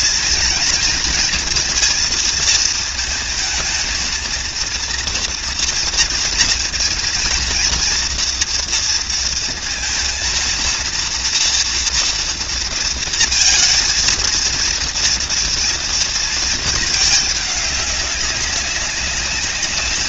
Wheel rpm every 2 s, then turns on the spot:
230, 220, 230, 230, 230, 230, 230, 230, 210, 200.
none